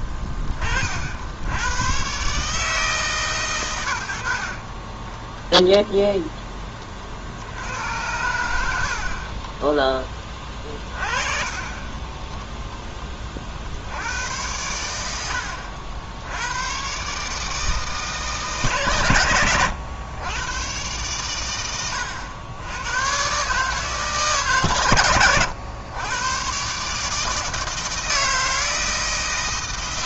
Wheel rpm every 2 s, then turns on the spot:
20, 150, 40, 10, 80, 20, 10, 90, 90, 150, 110, 90, 140, 130, 160.
4-6 10-12